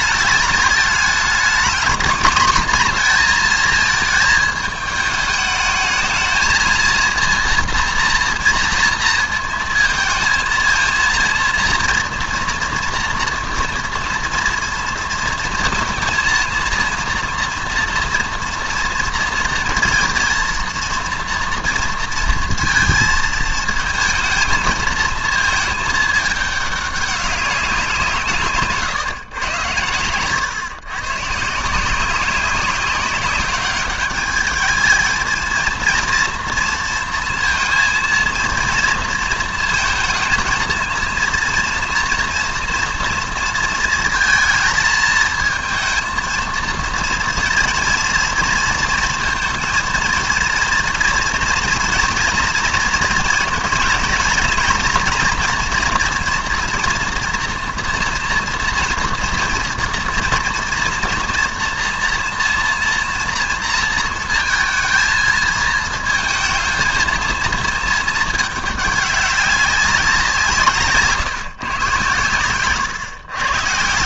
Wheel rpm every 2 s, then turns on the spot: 220, 240, 220, 230, 230, 230, 240, 230, 230, 230, 230, 230, 220, 210, 150, 130, 190, 210, 230, 230, 230, 230, 220, 230, 230, 230, 230, 230, 230, 230, 230, 230, 230, 220, 210, 160, 120.
28-30